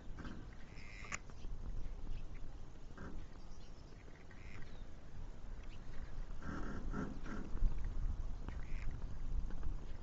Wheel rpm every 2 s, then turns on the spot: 0, 0, 0, 0, 0.
none